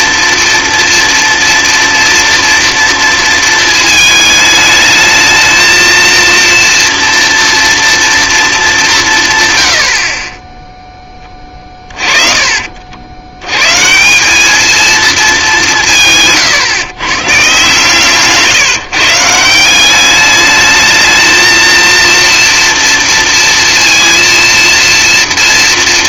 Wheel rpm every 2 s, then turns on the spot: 230, 230, 210, 230, 210, 10, 40, 220, 130, 150, 210, 230, 230.
none